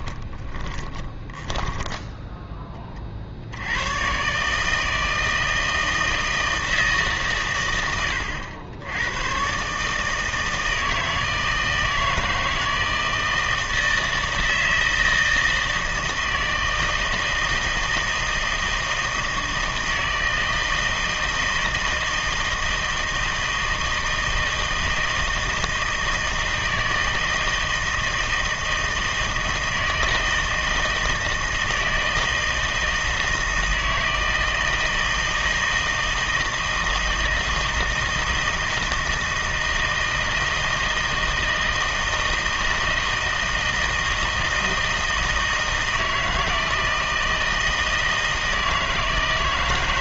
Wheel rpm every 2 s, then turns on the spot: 20, 10, 150, 160, 80, 160, 160, 160, 160, 160, 160, 160, 160, 160, 160, 160, 160, 160, 160, 160, 160, 160, 160, 160, 160.
0-2